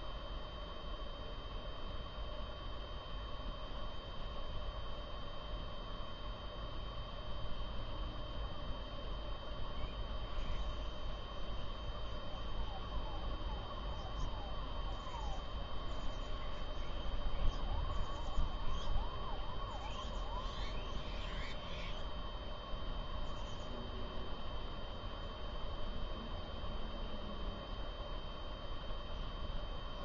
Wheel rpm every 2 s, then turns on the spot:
0, 0, 0, 0, 0, 0, 0, 0, 0, 0, 0, 0, 0, 0, 0.
none